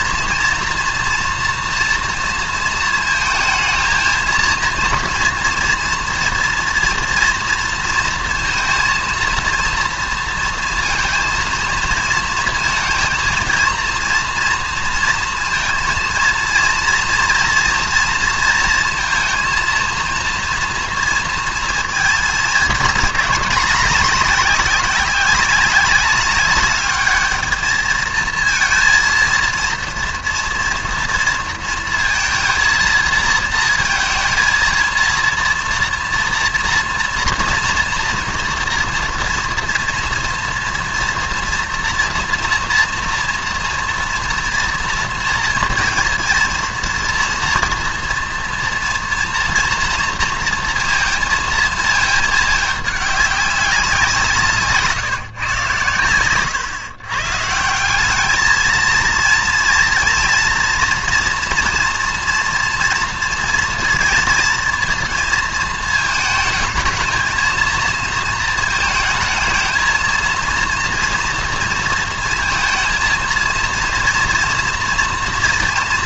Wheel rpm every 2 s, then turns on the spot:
230, 230, 230, 240, 230, 230, 220, 230, 230, 230, 230, 220, 200, 200, 230, 230, 230, 230, 240, 230, 230, 240, 230, 230, 240, 230, 210, 160, 120, 220, 230, 230, 220, 220, 220, 230, 230, 230.
none